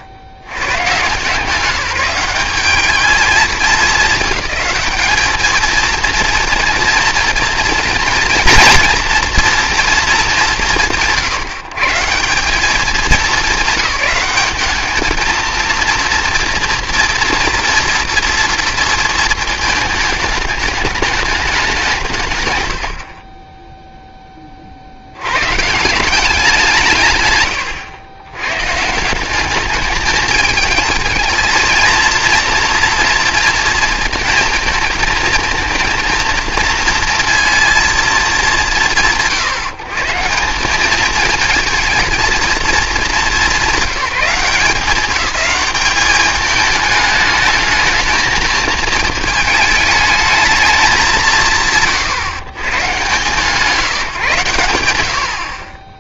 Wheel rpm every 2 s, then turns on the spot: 80, 200, 220, 240, 240, 160, 210, 210, 230, 230, 210, 110, 30, 170, 140, 210, 230, 230, 230, 170, 200, 210, 200, 210, 220, 220, 130, 100.
none